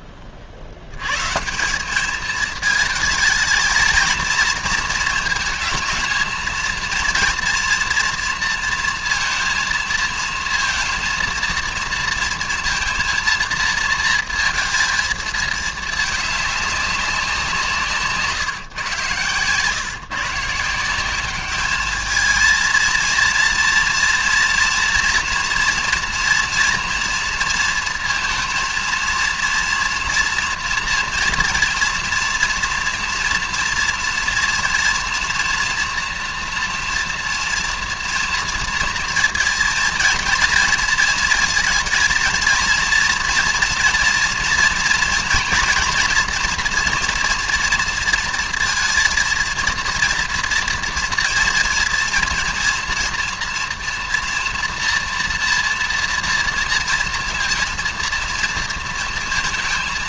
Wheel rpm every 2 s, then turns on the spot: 70, 210, 230, 230, 230, 230, 230, 230, 200, 140, 170, 220, 240, 230, 230, 230, 230, 230, 230, 230, 230, 230, 230, 240, 230, 230, 230, 240, 230, 230.
none